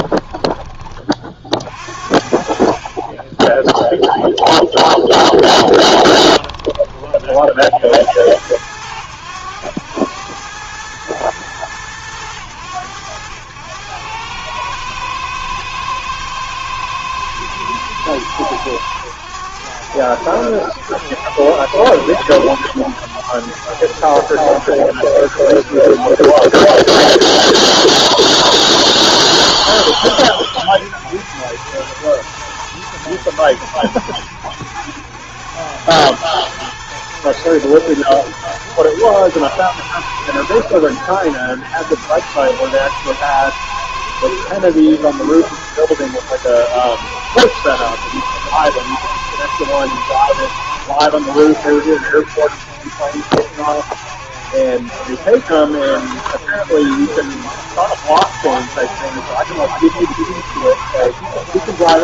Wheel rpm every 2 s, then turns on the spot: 20, 50, 0, 10, 80, 100, 100, 100, 120, 110, 90, 100, 100, 110, 110, 100, 110, 90, 110, 120, 100, 100, 100, 110, 110, 100, 90, 90, 90, 110, 110.
none